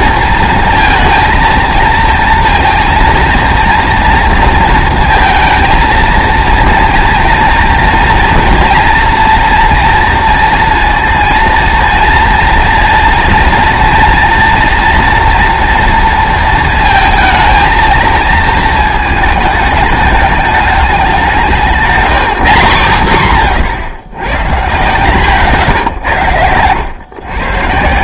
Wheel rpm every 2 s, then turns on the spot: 230, 230, 230, 230, 230, 230, 230, 230, 230, 220, 200, 150, 120, 100.
none